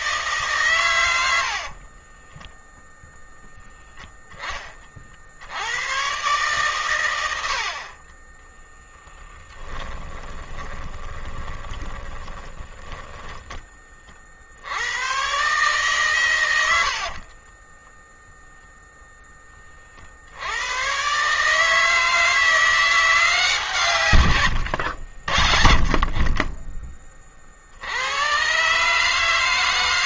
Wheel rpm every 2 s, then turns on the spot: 100, 0, 50, 120, 10, 20, 10, 110, 50, 0, 120, 170, 70, 30, 150.
8-14 16-18